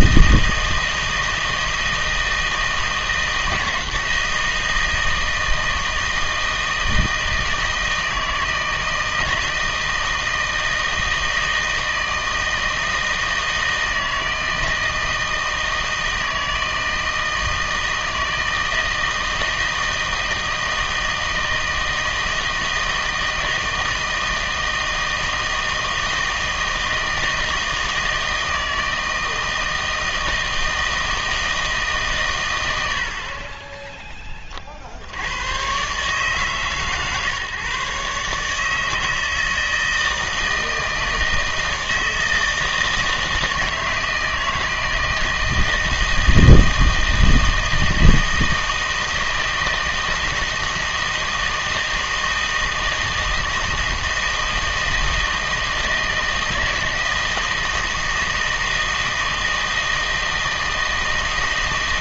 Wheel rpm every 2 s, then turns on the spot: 160, 160, 160, 160, 160, 160, 160, 160, 160, 160, 160, 160, 160, 160, 160, 160, 90, 50, 140, 150, 160, 160, 160, 160, 160, 160, 160, 160, 160, 160, 160.
none